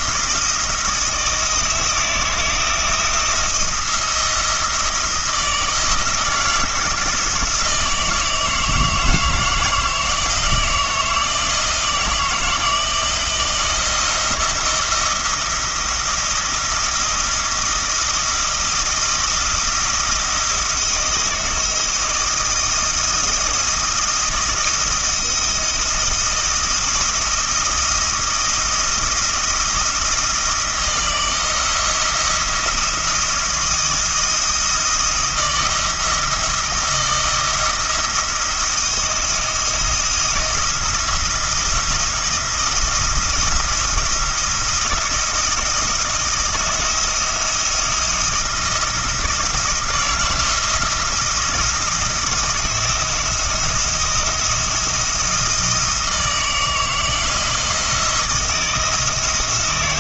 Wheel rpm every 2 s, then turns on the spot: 160, 160, 160, 160, 160, 160, 160, 170, 170, 170, 170, 170, 170, 170, 170, 160, 170, 170, 170, 170, 170, 170, 170, 170, 170, 160, 160, 160, 160, 160.
none